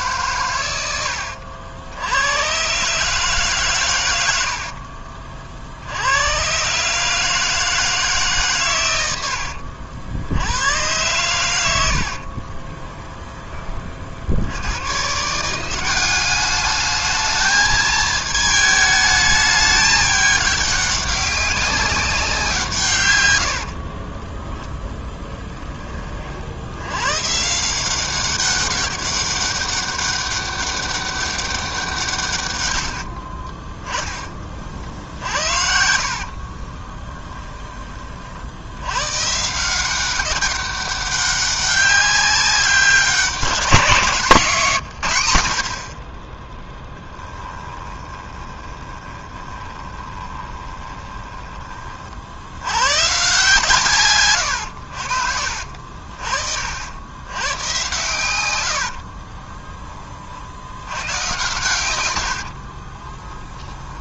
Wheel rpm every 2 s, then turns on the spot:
90, 140, 50, 140, 100, 110, 20, 130, 220, 210, 200, 130, 10, 100, 190, 200, 90, 50, 30, 100, 190, 200, 140, 10, 20, 20, 120, 70, 80, 70, 90, 30.
4-6 12-14 34-38 46-52 58-60 62-64